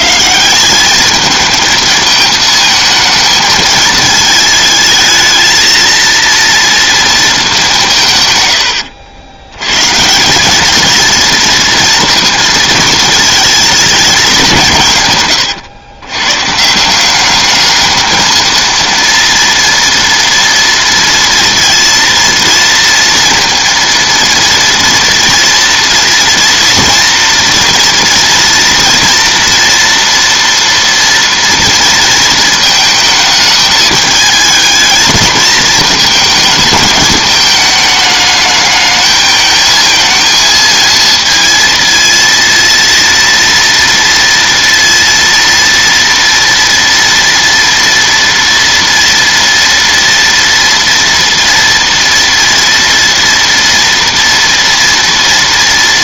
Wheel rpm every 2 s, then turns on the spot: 200, 220, 220, 230, 70, 220, 230, 150, 160, 230, 230, 230, 230, 230, 230, 230, 220, 220, 220, 220, 230, 230, 230, 230, 230, 230, 230, 230.
none